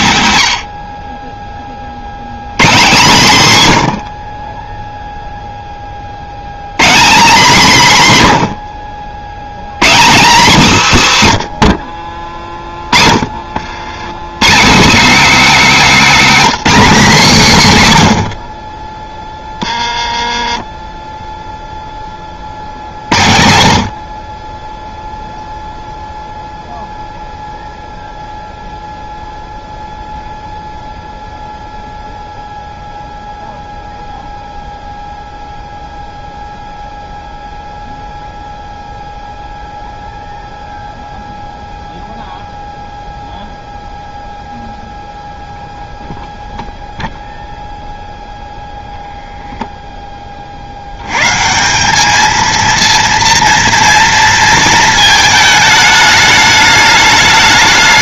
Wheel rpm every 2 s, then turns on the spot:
70, 160, 10, 170, 80, 200, 30, 200, 250, 40, 10, 60, 0, 0, 0, 0, 0, 0, 0, 0, 0, 0, 0, 0, 0, 60, 230, 230, 210.
12-14